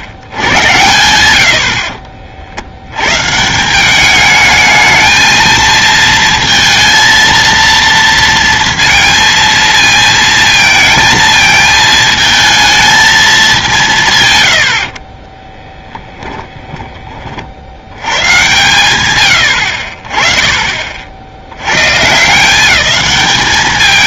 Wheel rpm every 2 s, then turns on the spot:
70, 60, 220, 230, 230, 230, 220, 110, 10, 130, 30, 190.
16-18